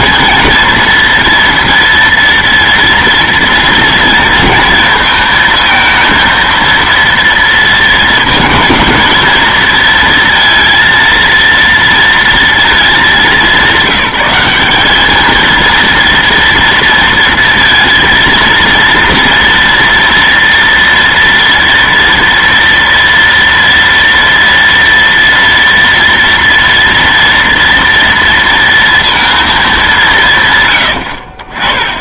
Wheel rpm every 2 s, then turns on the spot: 220, 230, 230, 230, 220, 230, 230, 190, 230, 230, 230, 230, 230, 230, 230, 160.
none